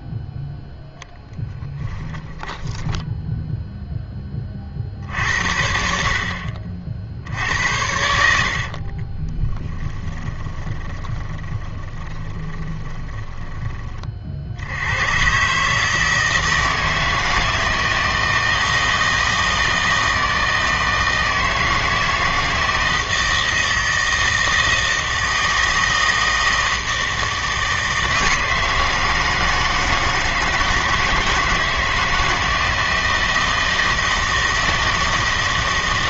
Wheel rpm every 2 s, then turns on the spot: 0, 10, 50, 60, 40, 20, 20, 80, 160, 160, 160, 160, 160, 160, 160, 160, 160, 160.
2-4 8-14